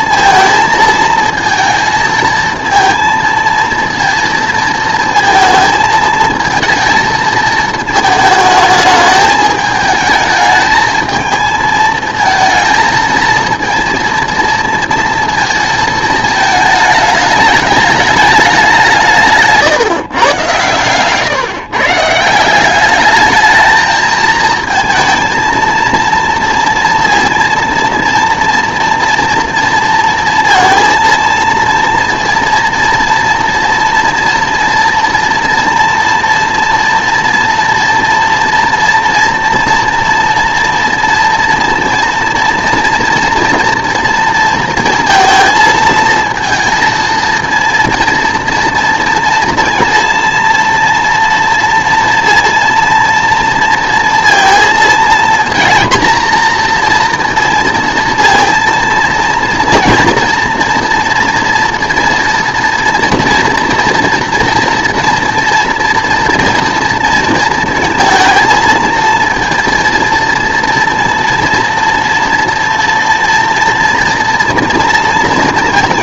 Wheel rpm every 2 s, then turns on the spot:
220, 220, 220, 220, 220, 220, 220, 230, 220, 190, 130, 190, 230, 230, 230, 230, 230, 230, 230, 230, 230, 230, 230, 230, 230, 230, 230, 230, 230, 230, 240, 230, 230, 230, 230, 230, 230, 230.
none